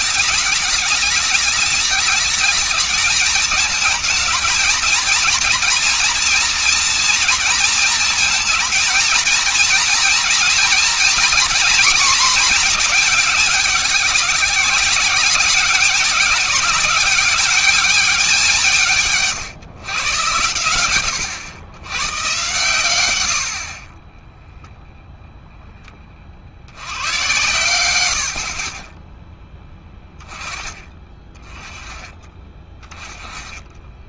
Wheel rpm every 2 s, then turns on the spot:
210, 210, 220, 230, 230, 230, 220, 200, 200, 190, 110, 120, 10, 60, 50, 20, 20.
24-26